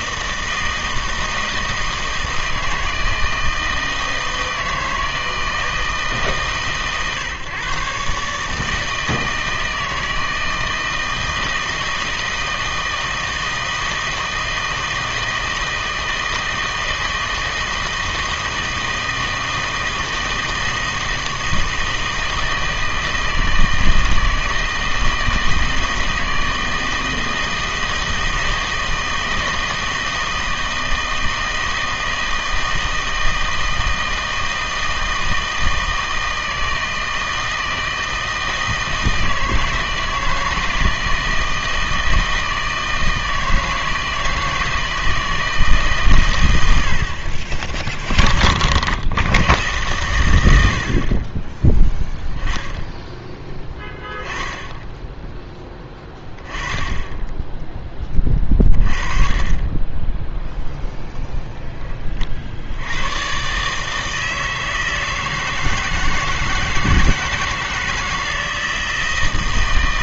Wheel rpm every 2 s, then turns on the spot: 160, 160, 160, 140, 160, 160, 160, 160, 160, 160, 160, 160, 160, 160, 160, 160, 160, 160, 160, 160, 160, 160, 160, 80, 40, 90, 10, 10, 20, 20, 0, 70, 160, 160, 160.
none